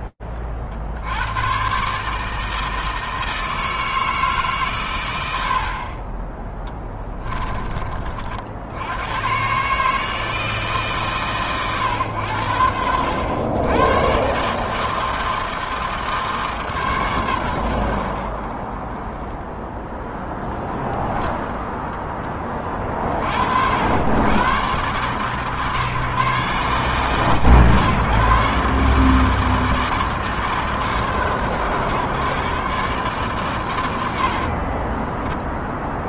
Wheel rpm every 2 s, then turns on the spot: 20, 160, 150, 20, 50, 150, 80, 140, 150, 40, 0, 10, 100, 130, 140, 150, 120, 80.
34-36